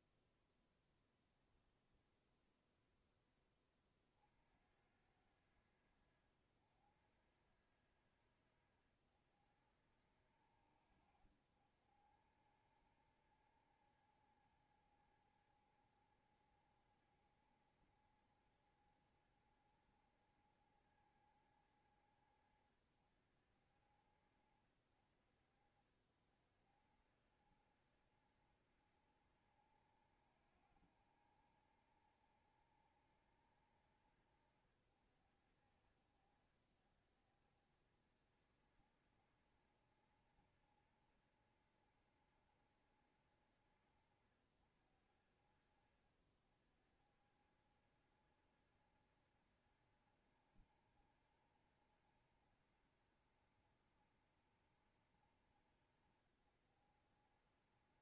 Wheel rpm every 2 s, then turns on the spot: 0, 0, 40, 70, 70, 60, 60, 70, 70, 70, 70, 60, 50, 50, 70, 70, 80, 70, 60, 70, 80, 80, 60, 60, 70, 80, 80, 80, 70.
none